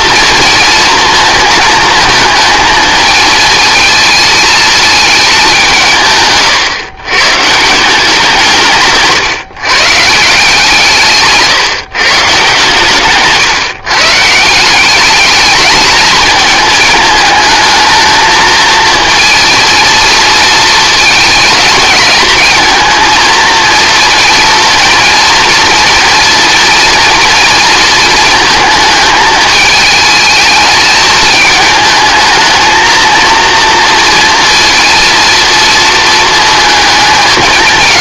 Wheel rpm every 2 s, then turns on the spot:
240, 220, 220, 130, 140, 160, 140, 180, 220, 230, 220, 220, 230, 230, 220, 220, 220, 230, 220.
none